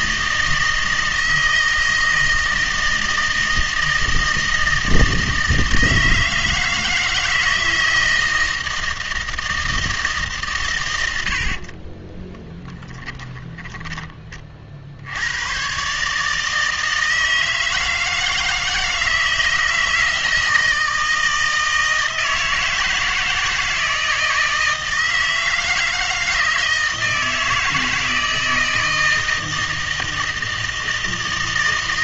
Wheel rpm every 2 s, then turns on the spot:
160, 160, 160, 160, 160, 120, 10, 60, 160, 160, 160, 160, 160, 160, 160, 160.
12-14